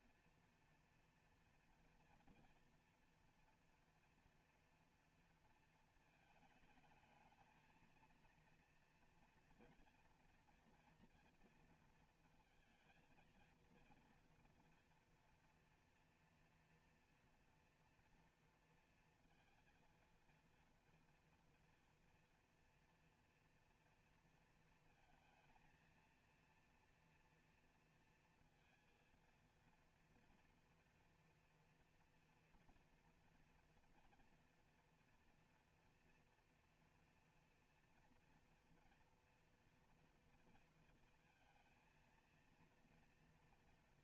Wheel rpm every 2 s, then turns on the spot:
230, 230, 240, 220, 230, 230, 230, 230, 240, 230, 230, 230, 230, 230, 230, 230, 240, 230, 230, 230, 230, 230.
none